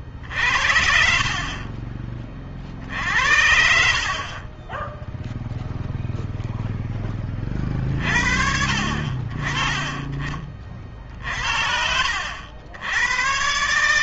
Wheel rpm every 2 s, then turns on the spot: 60, 60, 20, 10, 50, 50, 80.
none